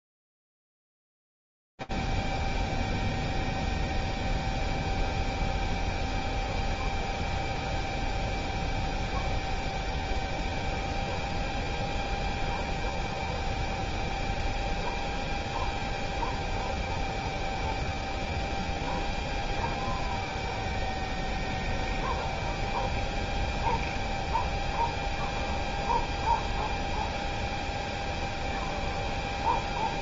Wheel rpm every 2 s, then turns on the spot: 0, 0, 0, 0, 0, 0, 0, 0, 0, 0, 0, 0, 0, 0, 0.
none